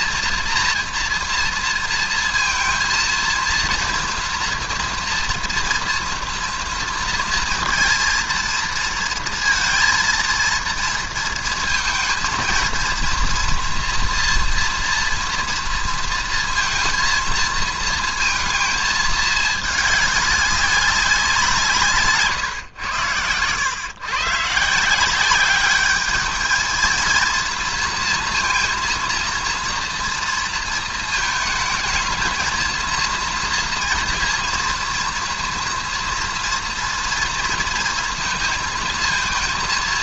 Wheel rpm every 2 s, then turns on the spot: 230, 230, 230, 230, 230, 230, 230, 230, 230, 230, 200, 120, 150, 220, 230, 230, 230, 230, 230, 230.
none